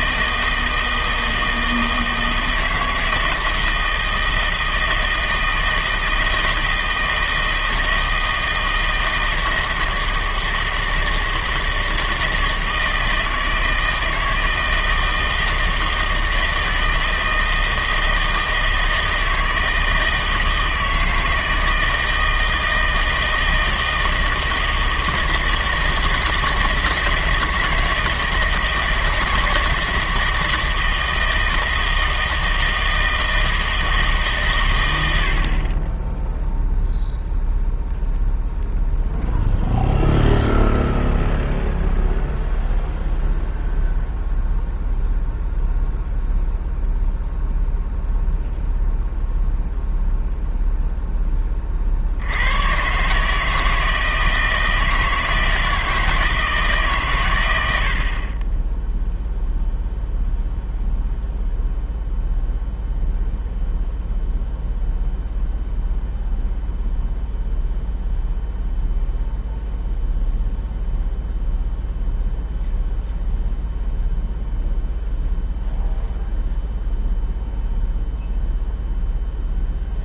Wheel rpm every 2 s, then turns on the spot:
160, 160, 160, 160, 160, 160, 160, 160, 160, 160, 160, 160, 160, 160, 160, 160, 160, 120, 0, 0, 0, 0, 0, 0, 0, 0, 100, 160, 150, 10, 0, 0, 0, 0, 0, 0, 0, 0, 0, 0.
none